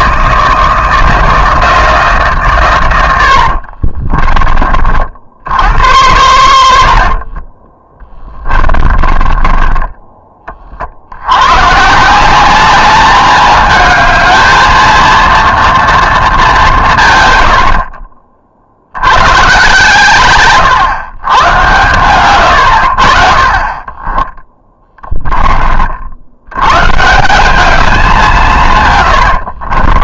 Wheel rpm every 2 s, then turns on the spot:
160, 110, 30, 80, 20, 40, 200, 220, 200, 50, 110, 90, 10, 110, 140.
8-10 20-22 24-26